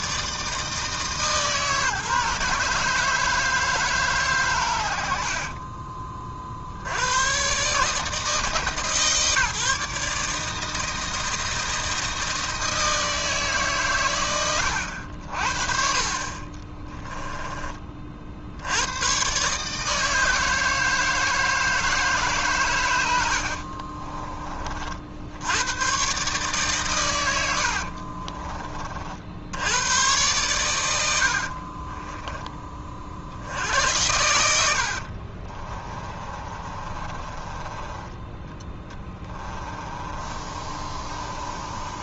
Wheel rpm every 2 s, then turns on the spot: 160, 150, 110, 60, 150, 160, 160, 90, 30, 80, 160, 120, 30, 140, 30, 110, 20, 80, 30, 10, 30.
14-18 34-42